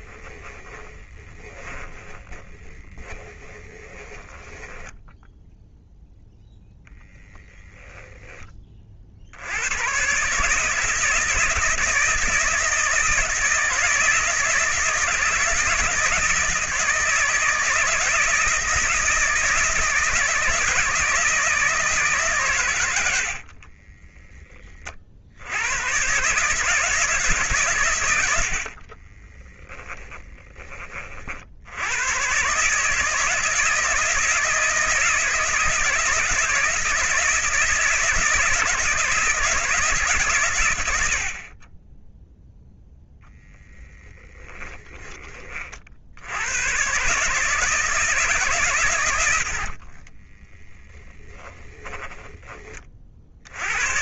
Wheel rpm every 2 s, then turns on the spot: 20, 20, 10, 0, 40, 160, 160, 160, 160, 160, 160, 110, 40, 160, 30, 30, 150, 160, 160, 160, 70, 0, 20, 140, 120, 20, 40.
0-6 28-30 50-52